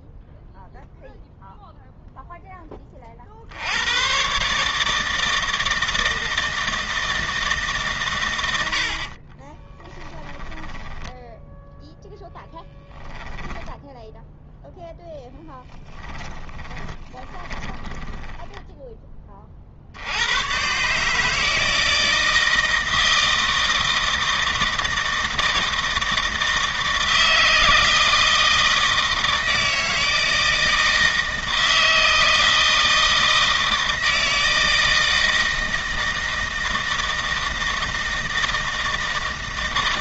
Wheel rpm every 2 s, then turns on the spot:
0, 20, 150, 160, 60, 10, 10, 0, 20, 10, 130, 160, 160, 160, 160, 160, 160, 160, 160, 160.
10-12 16-18